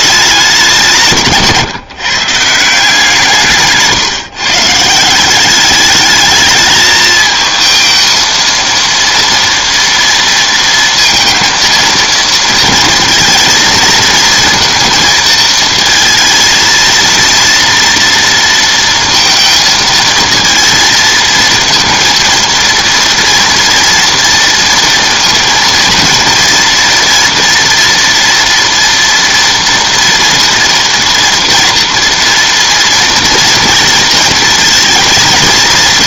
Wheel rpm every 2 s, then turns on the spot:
170, 170, 160, 220, 230, 230, 230, 230, 230, 230, 230, 230, 230, 230, 230, 230, 230, 230.
none